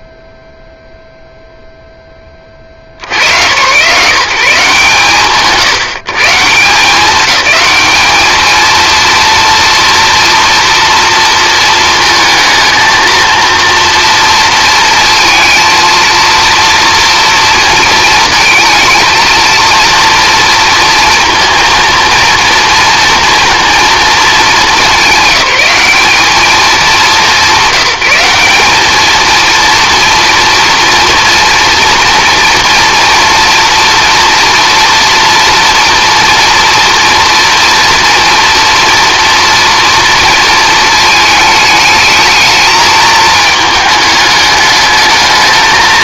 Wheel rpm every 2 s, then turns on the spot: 0, 40, 140, 180, 230, 240, 220, 230, 230, 230, 230, 230, 220, 210, 210, 230, 230, 230, 230, 240, 230, 220, 210.
none